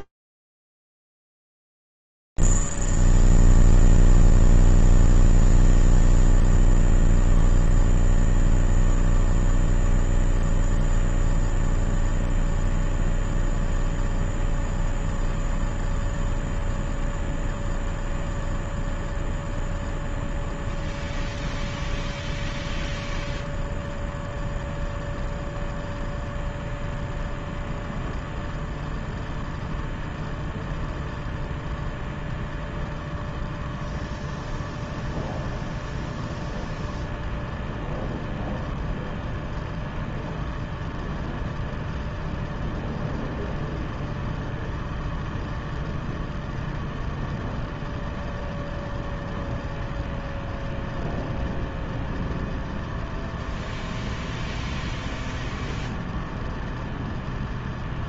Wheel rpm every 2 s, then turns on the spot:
0, 0, 0, 0, 0, 0, 0, 0, 0, 0, 0, 0, 0, 0, 0, 0, 0, 0, 0, 0, 0, 0, 0, 0, 0, 0, 0, 0, 0.
none